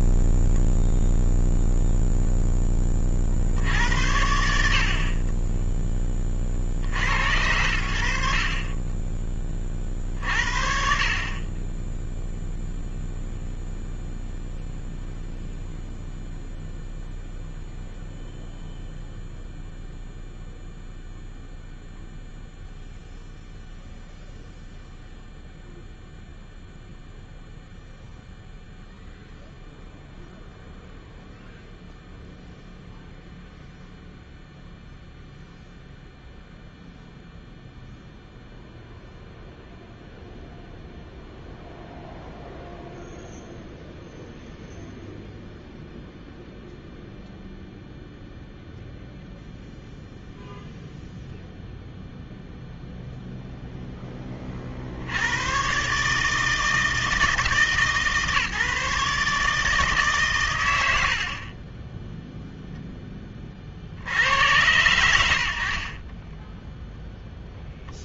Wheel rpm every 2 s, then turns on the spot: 10, 0, 70, 0, 80, 50, 10, 0, 0, 0, 0, 0, 0, 0, 0, 0, 0, 0, 0, 0, 0, 0, 0, 0, 0, 0, 0, 30, 160, 150, 90, 0, 110, 0.
none